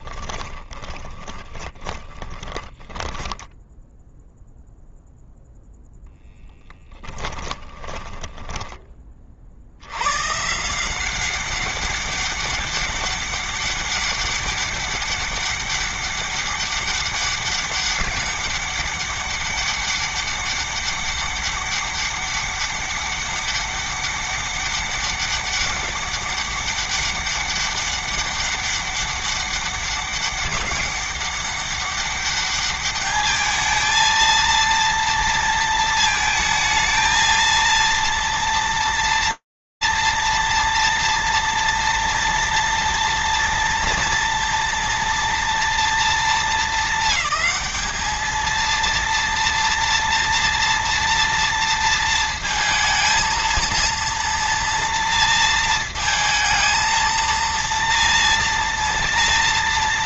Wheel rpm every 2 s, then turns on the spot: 20, 10, 0, 10, 20, 160, 200, 200, 200, 200, 200, 200, 200, 200, 200, 200, 210, 230, 220, 230, 230, 230, 230, 210, 230, 230, 230, 230, 230, 240.
0-4 6-8